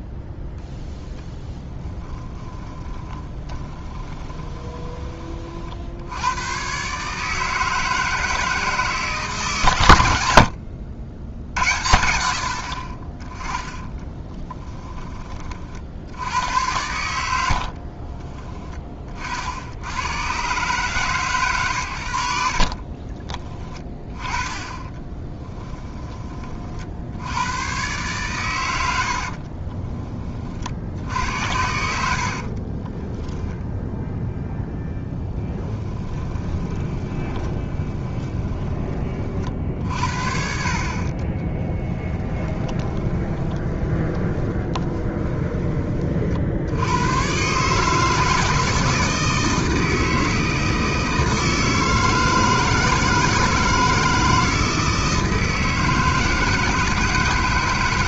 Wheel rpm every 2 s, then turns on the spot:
10, 10, 20, 130, 160, 80, 40, 20, 100, 20, 140, 50, 20, 60, 80, 60, 20, 0, 20, 20, 40, 20, 30, 100, 160, 160, 160, 160, 160.
2-4 22-26 28-30 32-34 36-38 42-46